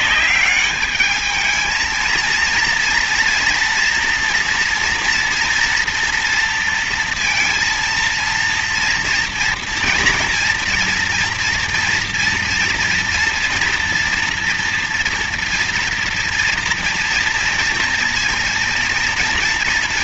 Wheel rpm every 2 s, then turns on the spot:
200, 230, 240, 230, 230, 230, 230, 230, 230, 230.
none